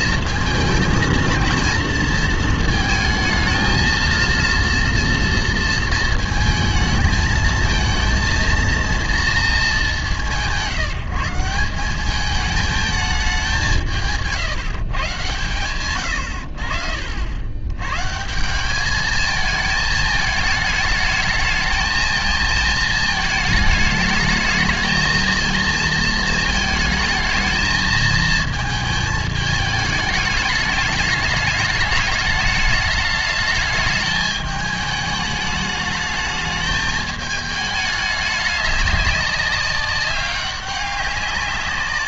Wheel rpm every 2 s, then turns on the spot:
220, 220, 230, 220, 230, 150, 220, 160, 70, 190, 210, 220, 220, 220, 220, 210, 210, 210, 210, 200, 200.
none